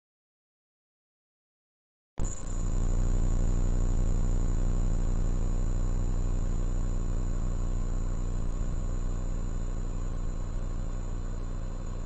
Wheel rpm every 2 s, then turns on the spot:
0, 0, 0, 0, 0, 0.
none